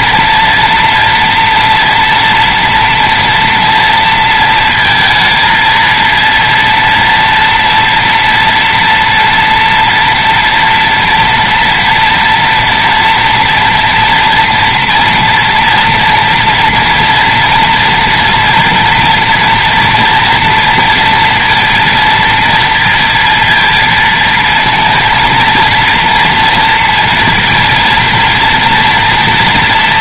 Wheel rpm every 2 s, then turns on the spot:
240, 230, 230, 230, 230, 240, 230, 240, 230, 230, 230, 230, 230, 230, 230.
none